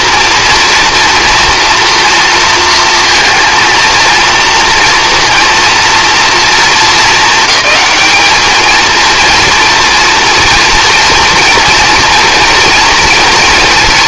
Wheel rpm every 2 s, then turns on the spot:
230, 230, 230, 220, 220, 230, 230.
none